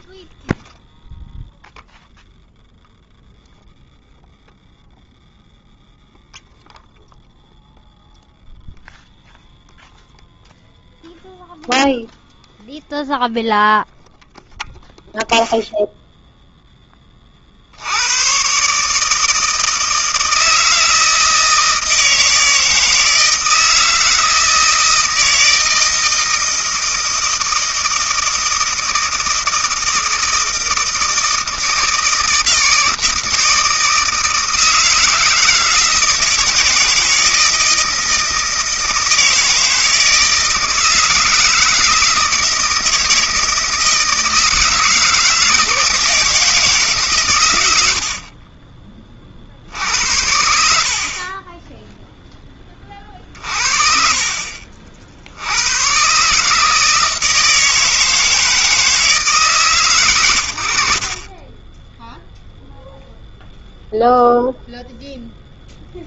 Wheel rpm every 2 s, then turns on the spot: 10, 0, 0, 0, 0, 0, 0, 0, 0, 130, 160, 160, 160, 160, 160, 160, 160, 160, 160, 160, 160, 160, 160, 160, 40, 80, 10, 50, 140, 160, 90, 0, 0.
48-50